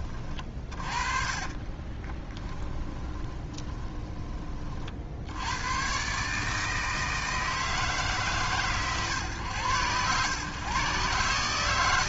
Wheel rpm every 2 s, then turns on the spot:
30, 20, 30, 160, 130, 120.
2-4